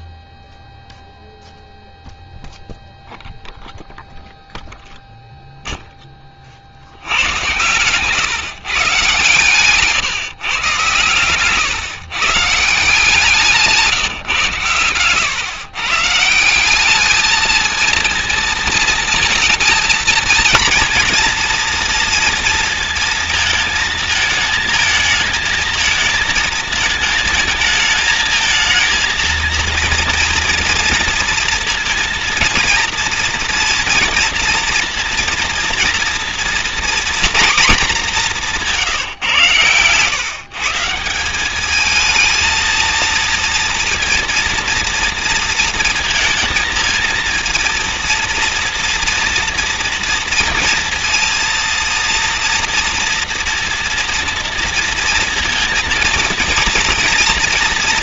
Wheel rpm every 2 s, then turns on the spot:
0, 0, 0, 120, 130, 130, 170, 120, 220, 230, 230, 220, 220, 220, 230, 230, 230, 230, 230, 120, 200, 230, 230, 230, 230, 230, 240, 230, 230.
12-14